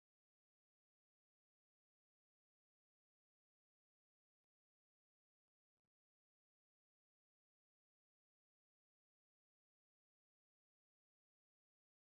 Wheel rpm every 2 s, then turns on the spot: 0, 0, 0, 0, 0, 0.
none